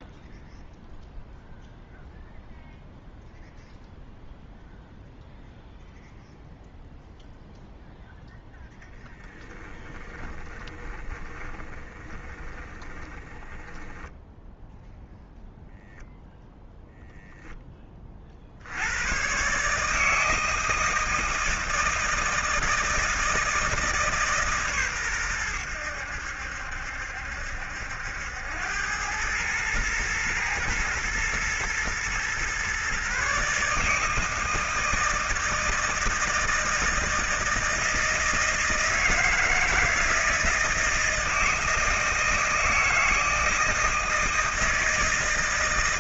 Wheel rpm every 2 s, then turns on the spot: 0, 0, 0, 0, 10, 20, 20, 0, 0, 100, 160, 160, 120, 70, 100, 110, 130, 160, 160, 160, 160, 160, 160.
10-14